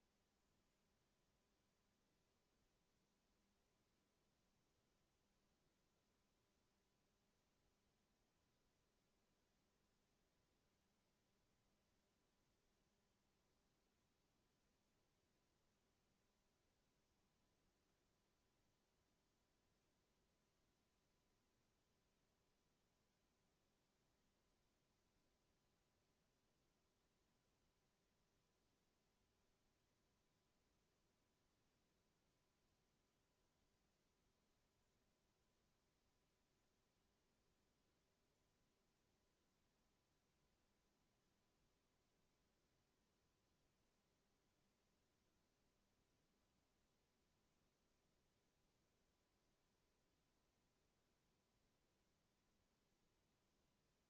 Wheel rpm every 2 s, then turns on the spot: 0, 0, 0, 0, 0, 0, 0, 0, 0, 0, 0, 0, 0, 0, 0, 0, 0, 0, 0, 0, 0, 0, 0, 0, 0, 0, 0.
none